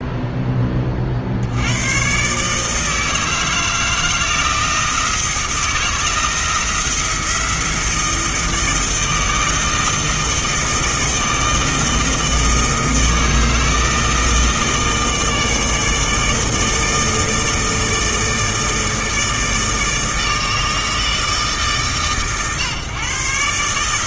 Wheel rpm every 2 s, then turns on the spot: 30, 160, 160, 170, 160, 160, 160, 160, 160, 160, 160, 130.
none